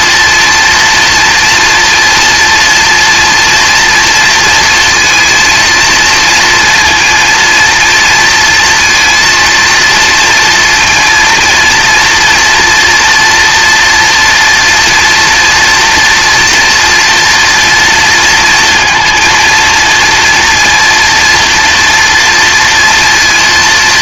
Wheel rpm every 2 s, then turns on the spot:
230, 230, 230, 230, 230, 230, 230, 230, 230, 230, 240, 230.
none